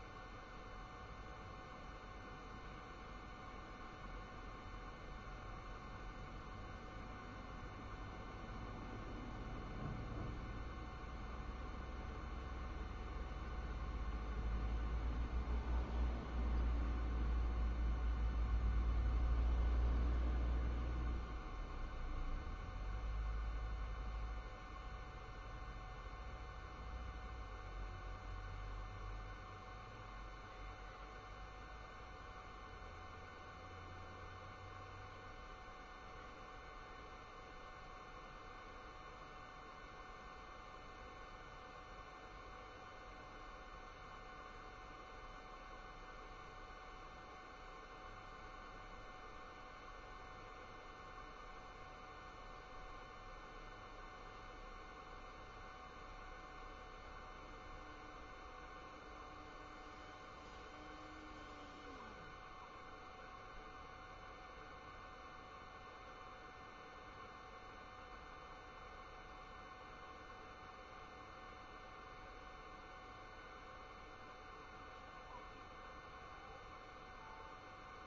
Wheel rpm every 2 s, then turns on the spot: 0, 0, 0, 0, 0, 0, 0, 0, 0, 0, 0, 0, 0, 0, 0, 0, 0, 0, 0, 0, 0, 0, 0, 0, 0, 0, 0, 0, 0, 0, 0, 0, 0, 0, 0, 0, 0, 0, 0.
none